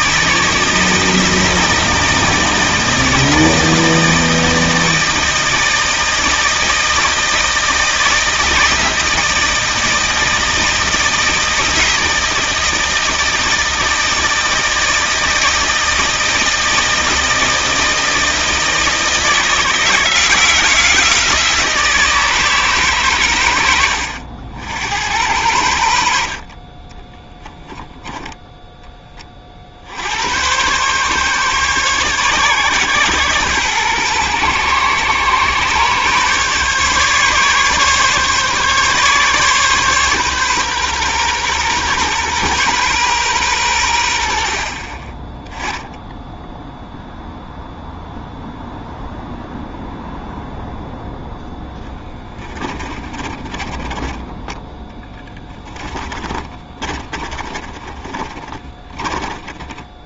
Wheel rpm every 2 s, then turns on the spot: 160, 160, 160, 160, 160, 160, 160, 160, 160, 160, 170, 140, 80, 30, 10, 120, 130, 120, 140, 140, 130, 120, 50, 0, 0, 0, 20, 10, 30, 20.
26-28 52-54 56-60